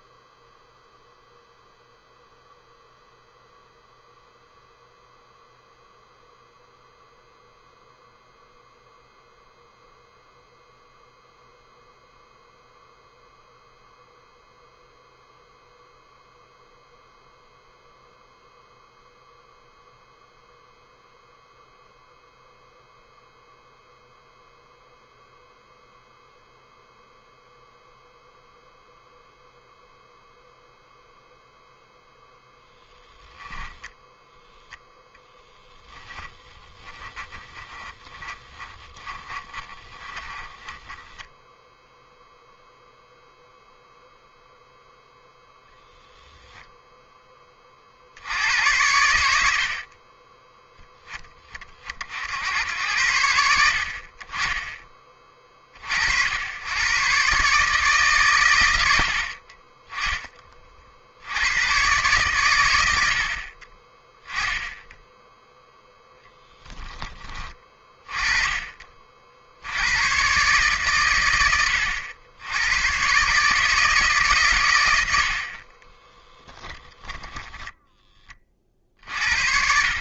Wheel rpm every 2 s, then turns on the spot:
0, 0, 0, 0, 0, 0, 0, 0, 0, 0, 0, 0, 0, 0, 0, 0, 0, 0, 20, 20, 10, 0, 0, 10, 90, 10, 90, 30, 110, 80, 50, 80, 0, 10, 40, 120, 110, 90, 10, 40.
36-42